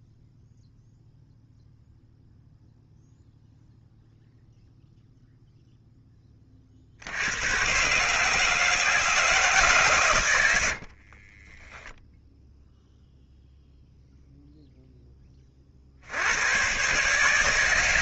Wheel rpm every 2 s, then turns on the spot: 0, 0, 0, 40, 160, 70, 0, 0, 120.
10-12